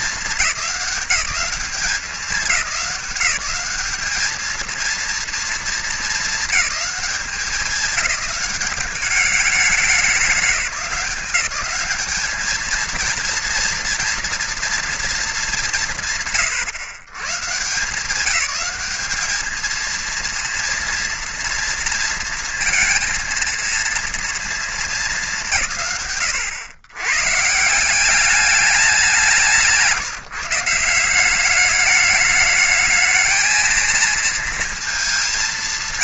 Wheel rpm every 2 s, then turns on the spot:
190, 180, 230, 200, 200, 190, 230, 230, 140, 210, 230, 230, 200, 140, 180, 180, 220, 220.
none